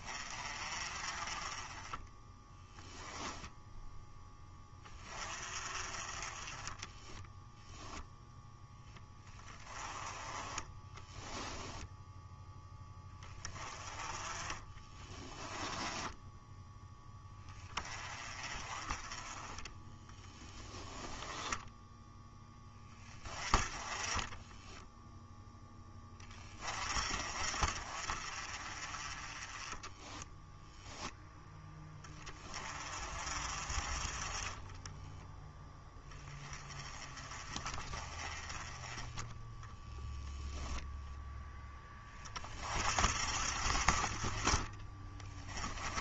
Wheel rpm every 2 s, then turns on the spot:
30, 10, 20, 10, 10, 10, 10, 20, 10, 20, 10, 10, 10, 30, 30, 0, 30, 10, 20, 10, 10, 40, 20.
2-4 6-8 10-12 14-16 20-22 34-36